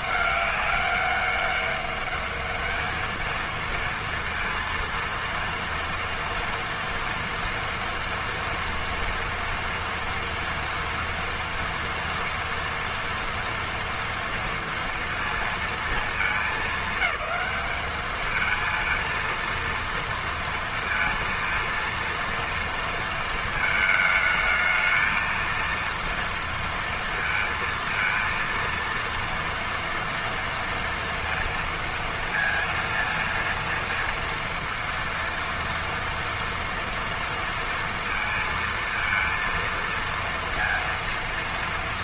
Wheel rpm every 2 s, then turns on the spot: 200, 220, 230, 230, 230, 230, 230, 230, 210, 230, 230, 230, 220, 230, 230, 230, 230, 230, 230, 230, 230.
none